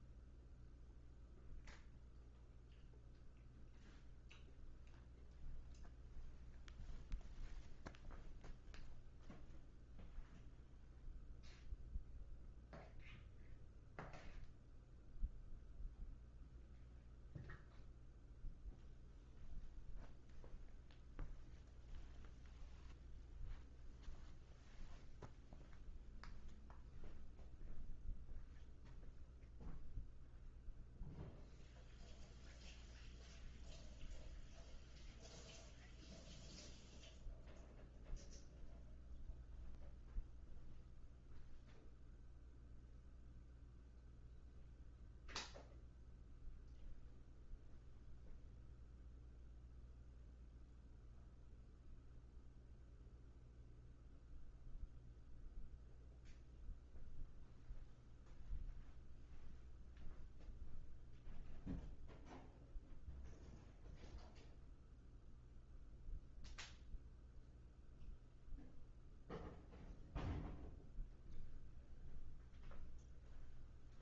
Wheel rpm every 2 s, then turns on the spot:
0, 0, 0, 0, 0, 0, 0, 0, 0, 0, 0, 0, 0, 0, 0, 0, 0, 0, 0, 0, 0, 0, 0, 0, 0, 0, 0, 0, 0, 0, 0, 0, 0, 0, 0, 0, 0.
none